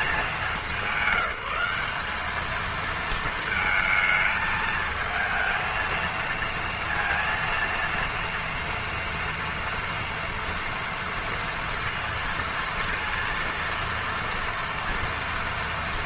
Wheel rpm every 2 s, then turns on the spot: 210, 210, 220, 230, 230, 230, 230, 230.
none